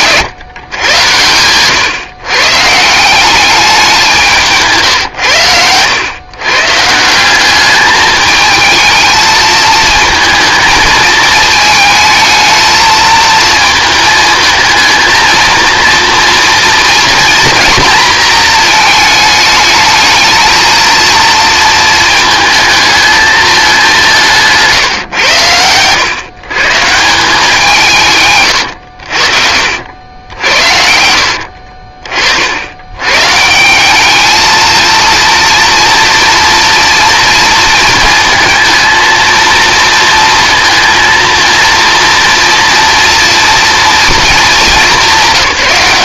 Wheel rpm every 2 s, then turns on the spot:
110, 170, 130, 160, 220, 220, 220, 220, 230, 220, 230, 220, 130, 170, 80, 70, 100, 230, 230, 230, 230, 230, 200.
0-2